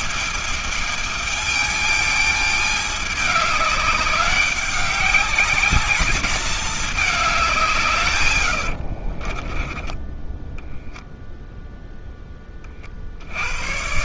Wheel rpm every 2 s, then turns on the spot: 220, 210, 200, 210, 110, 10, 20.
8-12